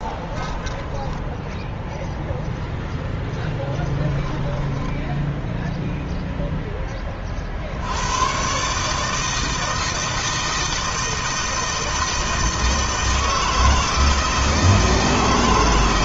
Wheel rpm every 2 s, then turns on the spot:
10, 0, 10, 20, 140, 160, 160, 160.
0-2 4-6